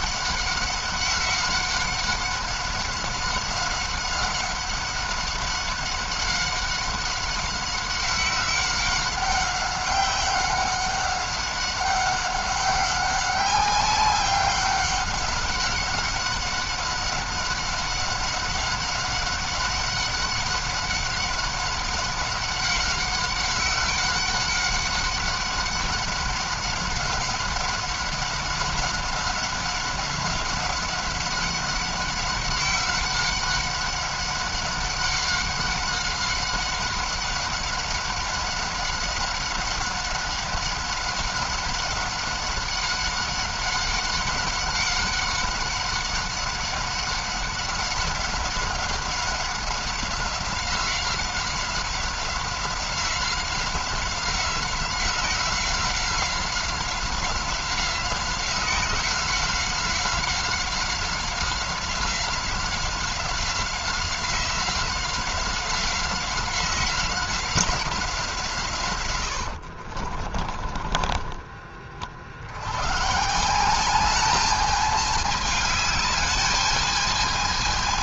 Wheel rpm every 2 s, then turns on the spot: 190, 190, 190, 190, 190, 190, 190, 190, 190, 190, 190, 190, 190, 190, 190, 190, 190, 190, 190, 190, 190, 190, 190, 190, 190, 190, 180, 180, 180, 180, 190, 180, 180, 180, 150, 30, 80, 210, 210.
70-72